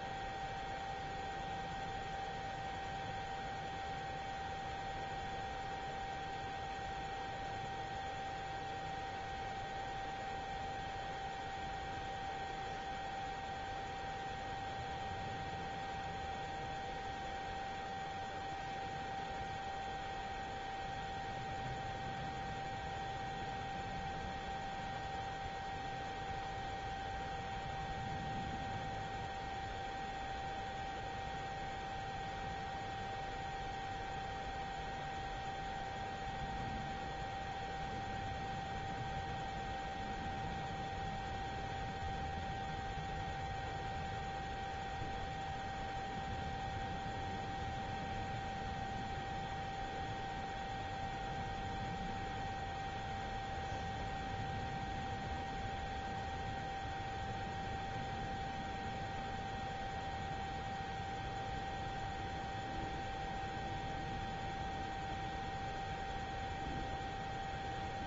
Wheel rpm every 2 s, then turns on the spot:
0, 0, 0, 0, 0, 0, 0, 0, 0, 0, 0, 0, 0, 0, 0, 0, 0, 0, 0, 0, 0, 0, 0, 0, 0, 0, 0, 0, 0, 0, 0, 0, 0, 0.
none